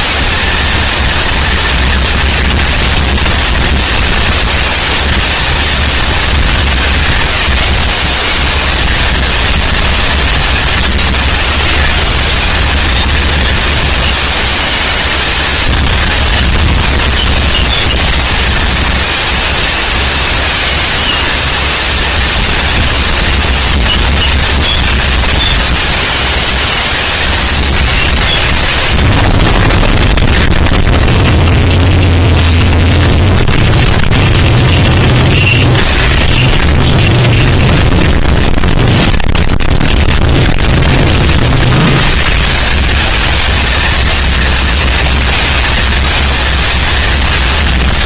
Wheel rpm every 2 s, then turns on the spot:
230, 230, 230, 200, 210, 210, 180, 230, 230, 230, 230, 230, 230, 220, 140, 0, 0, 0, 10, 10, 20, 120, 230, 220.
38-42